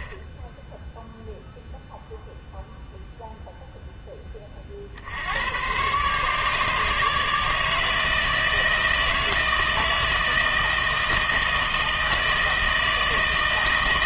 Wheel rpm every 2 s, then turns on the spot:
0, 0, 60, 150, 160, 160, 160.
none